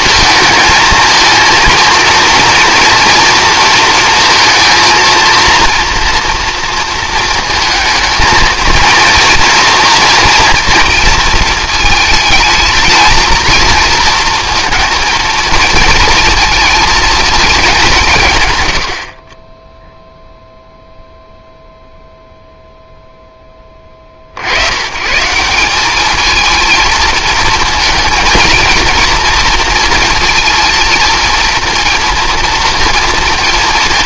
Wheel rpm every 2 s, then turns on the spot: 220, 230, 230, 230, 220, 230, 220, 230, 230, 100, 0, 0, 100, 230, 230, 230, 230.
none